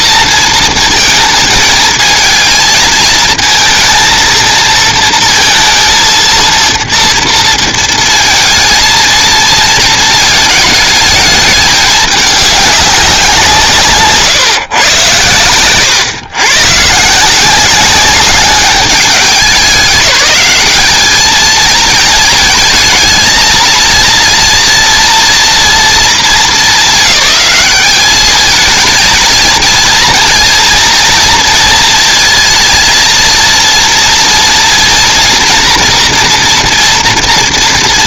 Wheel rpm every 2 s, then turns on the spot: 230, 220, 230, 230, 220, 220, 200, 130, 130, 200, 200, 220, 230, 210, 220, 230, 220, 230, 230.
none